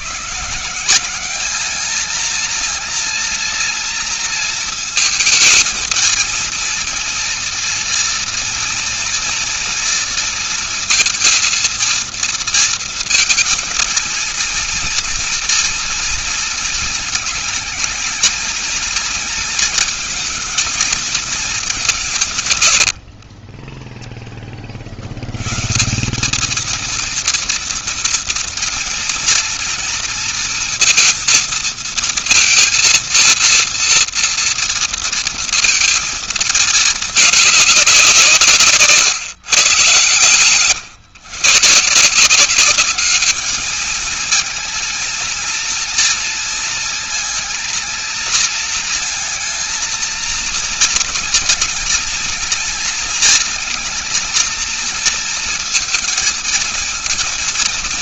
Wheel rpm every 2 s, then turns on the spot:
160, 230, 220, 220, 230, 230, 230, 230, 230, 230, 220, 130, 30, 210, 230, 230, 230, 230, 230, 170, 130, 180, 230, 220, 230, 230, 220, 230, 230.
22-24